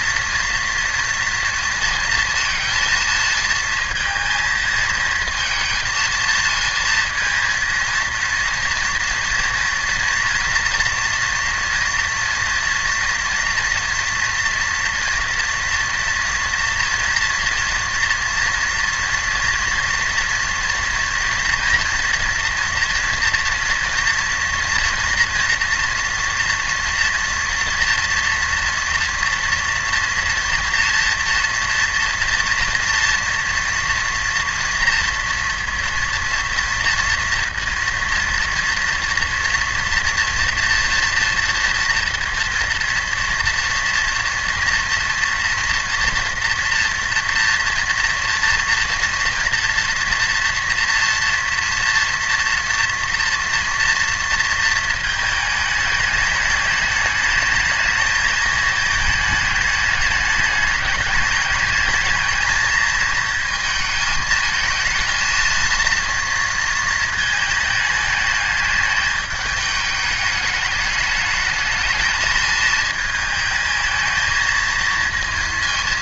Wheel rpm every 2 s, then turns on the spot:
230, 230, 220, 220, 230, 230, 230, 230, 240, 230, 240, 230, 230, 230, 230, 230, 230, 230, 230, 230, 230, 230, 230, 240, 240, 230, 240, 230, 210, 220, 210, 220, 220, 230, 210, 210, 220, 220.
none